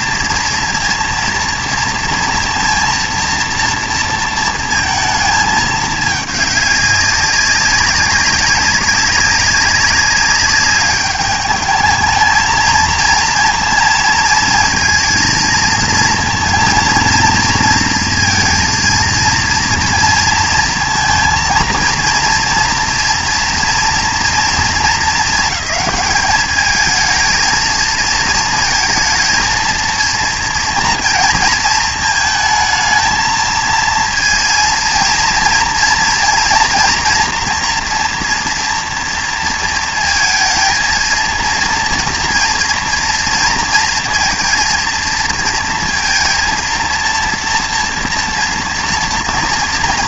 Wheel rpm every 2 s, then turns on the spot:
230, 230, 230, 200, 200, 200, 220, 230, 230, 230, 230, 240, 230, 220, 230, 230, 220, 230, 230, 230, 230, 230, 230, 230, 230.
none